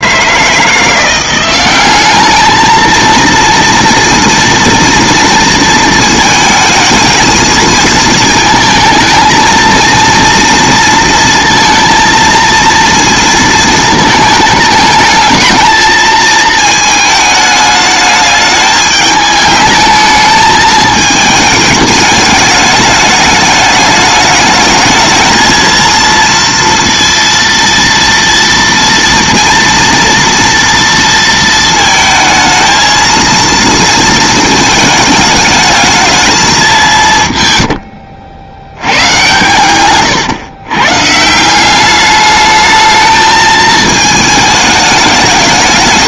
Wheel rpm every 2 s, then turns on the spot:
160, 210, 230, 220, 220, 230, 230, 220, 220, 210, 210, 210, 210, 230, 230, 230, 220, 220, 210, 80, 120, 210, 220.
none